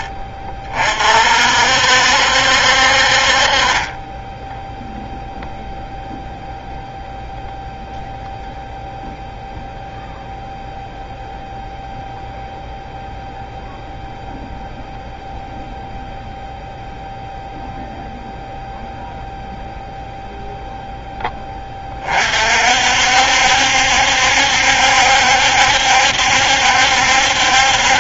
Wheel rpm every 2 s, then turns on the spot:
40, 60, 0, 0, 0, 0, 0, 0, 0, 0, 0, 50, 70, 70.
none